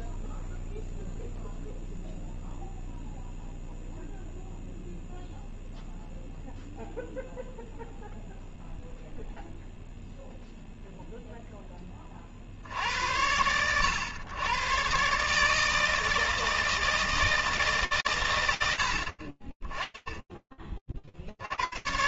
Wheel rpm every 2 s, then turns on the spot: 0, 0, 0, 0, 0, 30, 110, 160, 140, 10, 90.
none